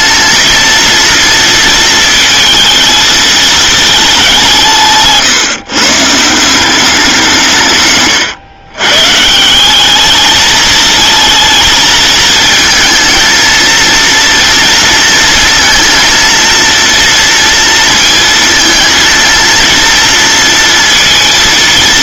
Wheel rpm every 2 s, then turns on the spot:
230, 220, 170, 180, 120, 220, 220, 230, 230, 230, 230.
none